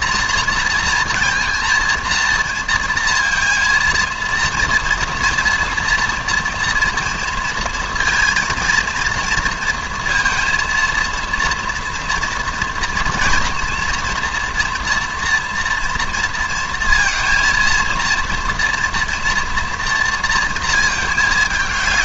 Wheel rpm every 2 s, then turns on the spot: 230, 230, 230, 240, 230, 230, 240, 240, 230, 230, 220.
none